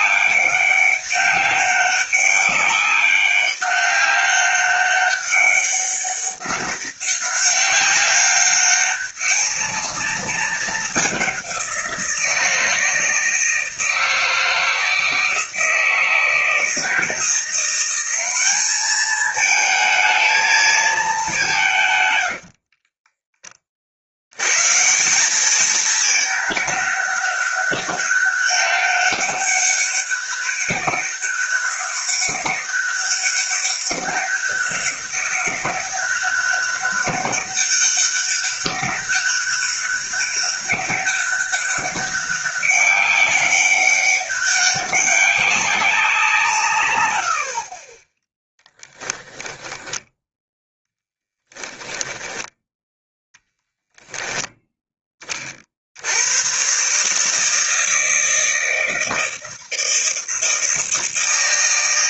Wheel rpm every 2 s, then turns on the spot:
200, 200, 200, 200, 210, 200, 160, 160, 170, 210, 210, 30, 170, 200, 200, 200, 200, 200, 200, 200, 200, 190, 200, 110, 10, 10, 10, 20, 150, 160, 160.
22-24 48-50 52-54